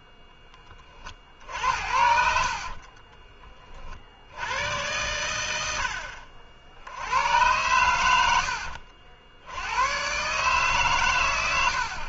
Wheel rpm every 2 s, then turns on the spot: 20, 60, 70, 70, 70, 140.
2-4